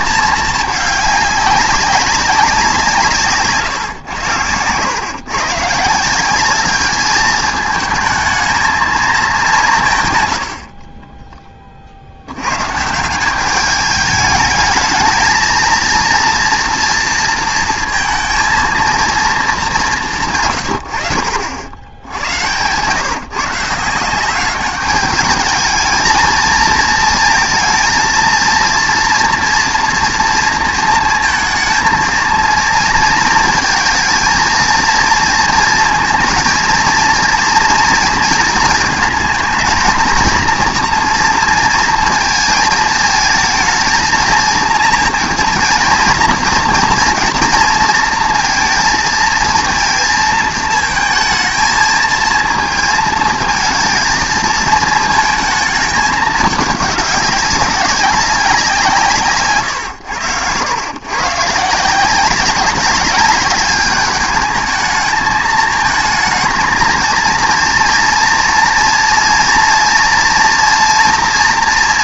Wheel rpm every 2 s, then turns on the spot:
210, 180, 110, 200, 220, 60, 120, 220, 230, 230, 110, 110, 200, 230, 230, 230, 230, 230, 230, 220, 230, 220, 230, 230, 230, 230, 230, 230, 210, 190, 110, 190, 210, 220, 230, 230.
none